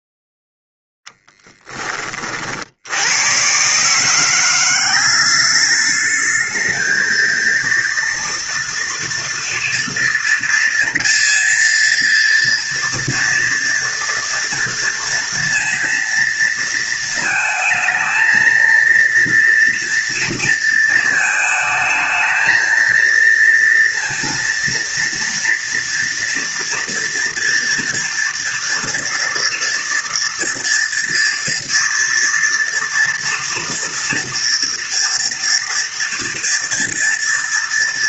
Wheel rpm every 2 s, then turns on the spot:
10, 90, 190, 230, 230, 230, 230, 230, 220, 230, 220, 230, 230, 230, 230, 230, 230, 230, 230.
none